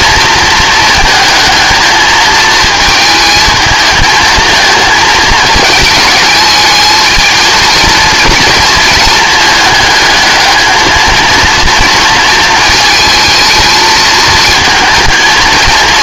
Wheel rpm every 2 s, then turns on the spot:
220, 220, 220, 220, 230, 220, 220, 220.
none